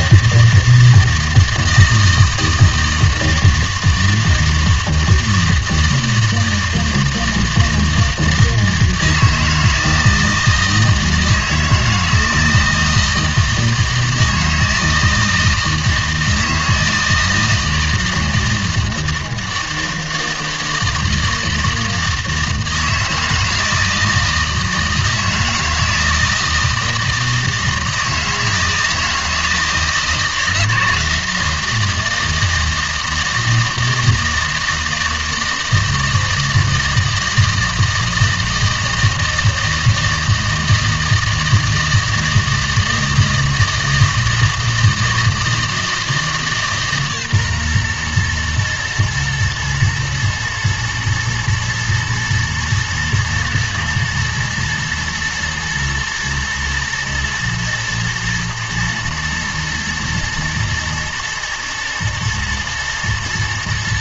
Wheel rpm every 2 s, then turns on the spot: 160, 160, 160, 160, 160, 160, 160, 160, 160, 160, 160, 160, 160, 160, 160, 160, 160, 160, 160, 160, 160, 160, 160, 150, 120, 110, 110, 110, 120, 120, 110, 120.
none